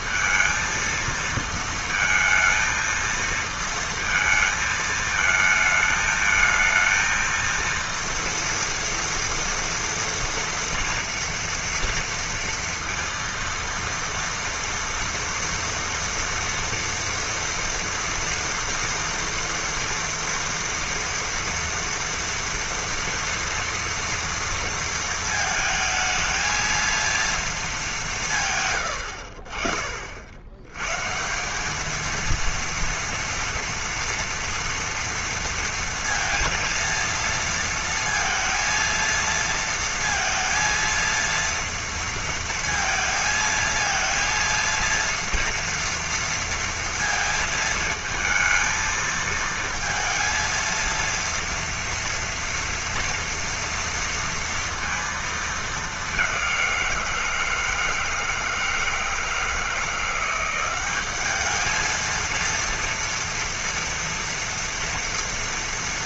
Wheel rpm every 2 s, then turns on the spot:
230, 230, 230, 220, 240, 230, 230, 230, 230, 230, 230, 230, 230, 230, 150, 90, 230, 230, 230, 230, 230, 230, 230, 230, 220, 230, 230, 230, 180, 160, 190, 230, 230.
28-30